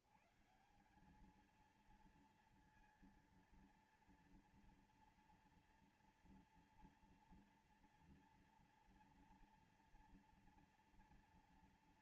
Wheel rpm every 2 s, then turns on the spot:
110, 230, 240, 240, 230, 240.
none